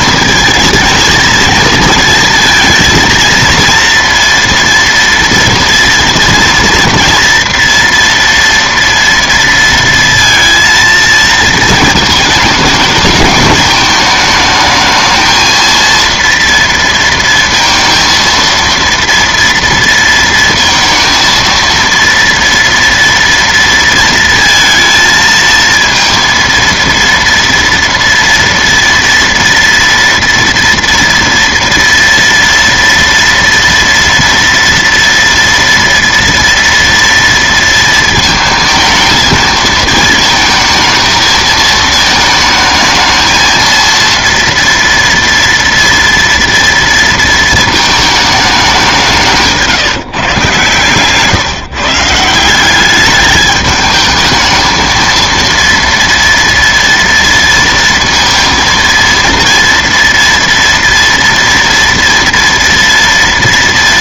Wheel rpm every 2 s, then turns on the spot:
220, 230, 230, 230, 230, 230, 220, 220, 230, 230, 230, 230, 230, 230, 230, 230, 230, 230, 230, 220, 220, 220, 230, 230, 190, 130, 190, 220, 230, 230, 230, 230.
50-52